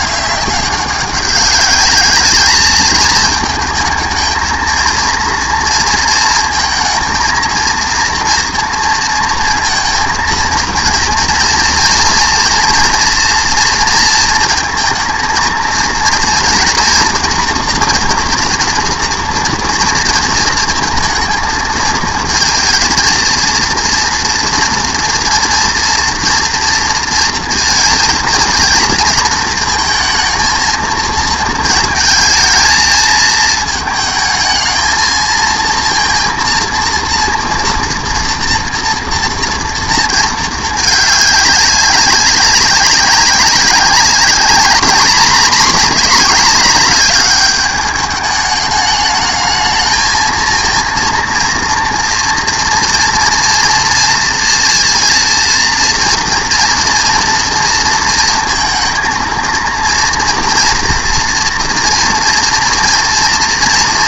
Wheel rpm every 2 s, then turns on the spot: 190, 210, 220, 230, 230, 230, 230, 230, 230, 230, 230, 230, 230, 230, 230, 230, 220, 220, 230, 230, 220, 200, 220, 210, 210, 230, 230, 230, 230, 230, 240, 230.
none